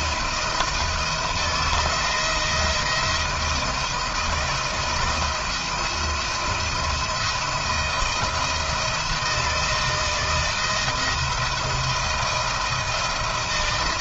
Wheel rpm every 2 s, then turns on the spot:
170, 170, 160, 170, 170, 170, 170.
none